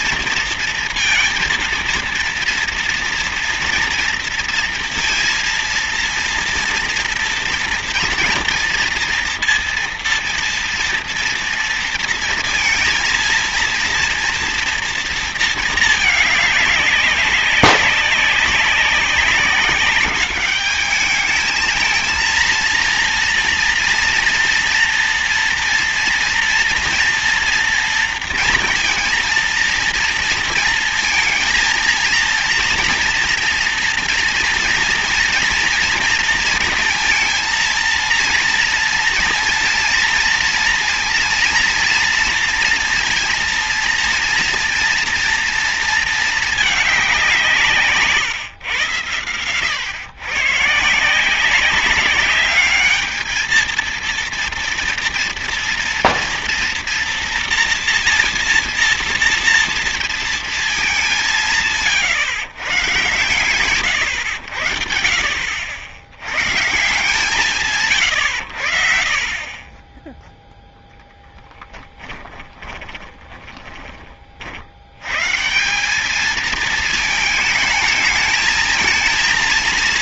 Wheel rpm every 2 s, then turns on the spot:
230, 230, 230, 230, 230, 230, 230, 230, 210, 200, 200, 230, 240, 230, 230, 230, 230, 230, 230, 230, 230, 230, 230, 210, 110, 140, 200, 230, 230, 240, 220, 120, 80, 130, 80, 0, 20, 60, 220, 220.
72-74